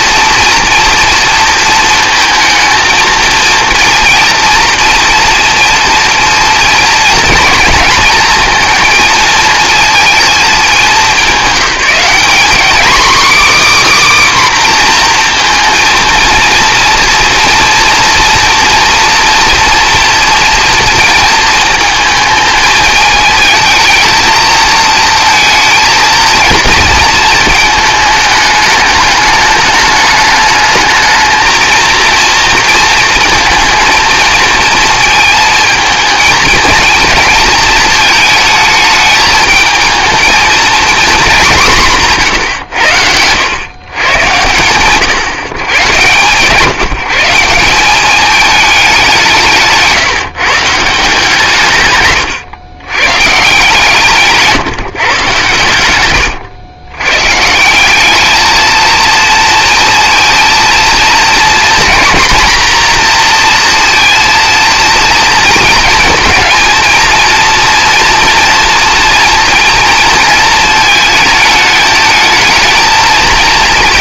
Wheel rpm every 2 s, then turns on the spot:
230, 220, 230, 240, 230, 210, 250, 260, 240, 230, 230, 220, 220, 230, 220, 210, 230, 230, 220, 220, 230, 110, 120, 150, 210, 160, 110, 140, 110, 220, 230, 240, 230, 230, 230, 220, 220.
none